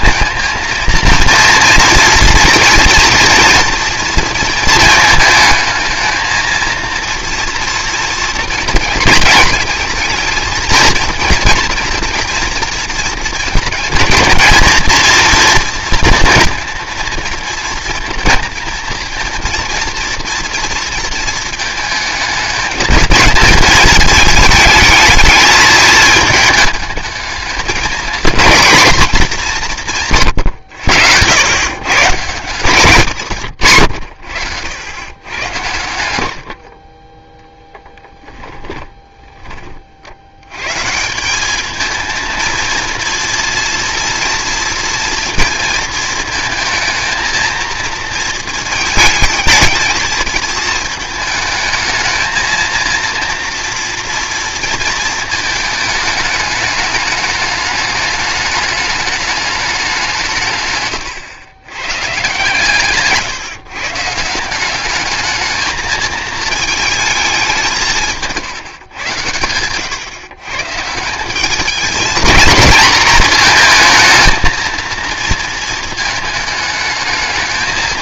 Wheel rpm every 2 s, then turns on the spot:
230, 230, 220, 230, 230, 230, 240, 220, 230, 230, 230, 220, 220, 220, 230, 100, 160, 100, 60, 10, 130, 230, 230, 220, 220, 220, 220, 230, 210, 210, 140, 140, 190, 220, 130, 150, 220, 230, 210.
38-40